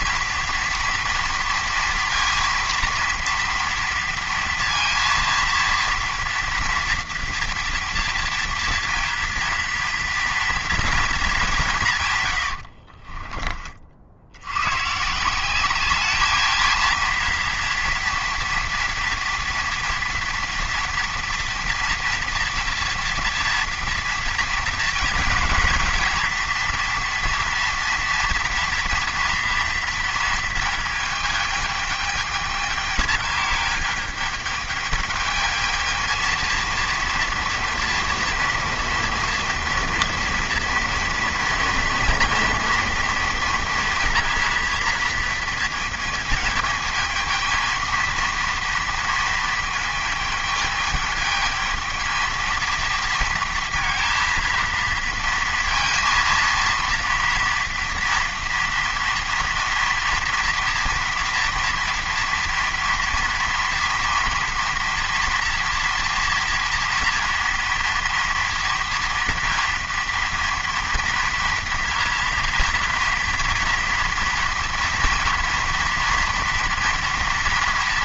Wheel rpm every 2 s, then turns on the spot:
230, 230, 230, 230, 230, 240, 70, 110, 220, 240, 240, 230, 230, 230, 230, 220, 220, 220, 230, 230, 240, 230, 230, 220, 230, 210, 230, 230, 230, 230, 230, 230, 240, 230, 230, 230, 230, 230, 230.
12-14